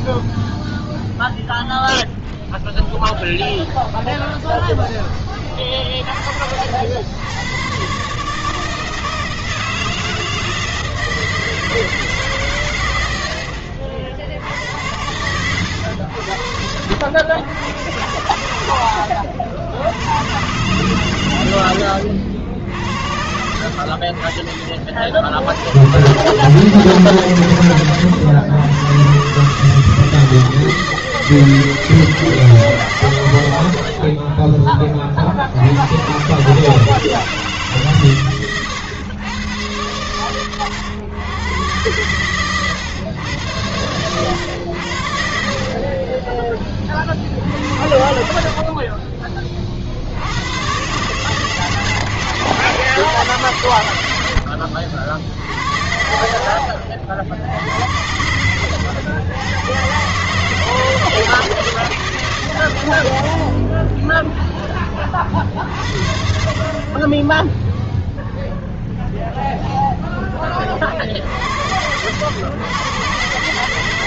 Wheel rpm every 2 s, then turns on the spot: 0, 0, 0, 50, 160, 160, 140, 80, 90, 90, 120, 60, 40, 130, 100, 160, 150, 30, 140, 120, 110, 130, 100, 30, 50, 100, 150, 90, 60, 100, 150, 120, 0, 40, 0, 20, 110.
48-50